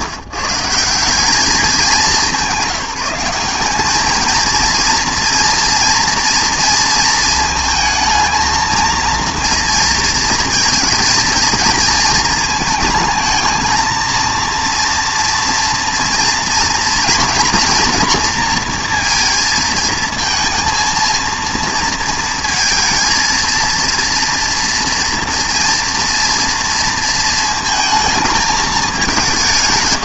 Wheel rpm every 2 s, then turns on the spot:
160, 190, 230, 230, 220, 230, 220, 230, 230, 230, 230, 220, 230, 230, 210.
none